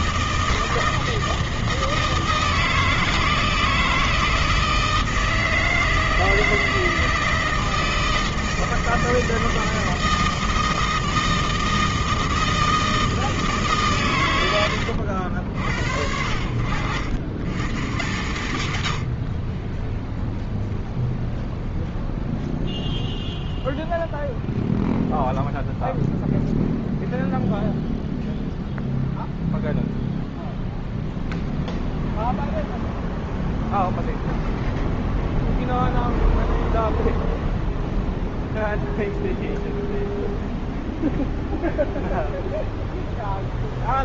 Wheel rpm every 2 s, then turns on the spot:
160, 160, 160, 160, 160, 160, 160, 70, 90, 70, 0, 0, 0, 0, 0, 0, 0, 0, 0, 0, 0, 0.
none